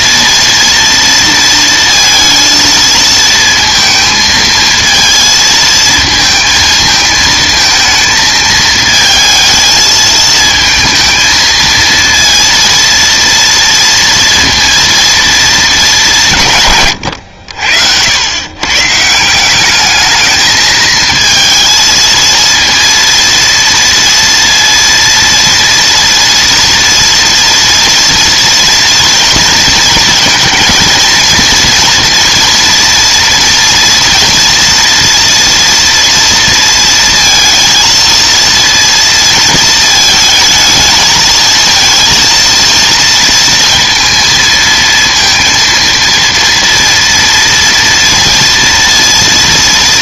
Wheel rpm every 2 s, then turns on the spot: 230, 230, 230, 220, 220, 220, 230, 230, 160, 130, 220, 230, 230, 230, 230, 230, 230, 230, 230, 230, 220, 230, 230, 230, 230.
none